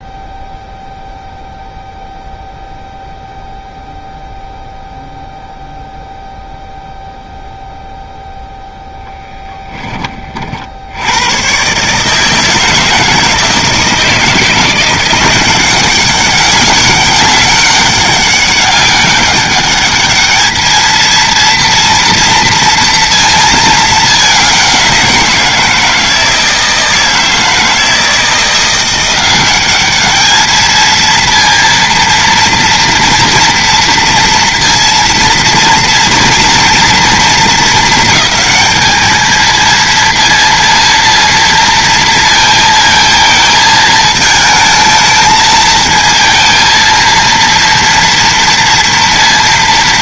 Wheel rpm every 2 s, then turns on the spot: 0, 0, 0, 0, 0, 60, 160, 170, 200, 200, 220, 230, 190, 160, 170, 220, 230, 230, 230, 220, 230, 230, 220, 230, 230.
none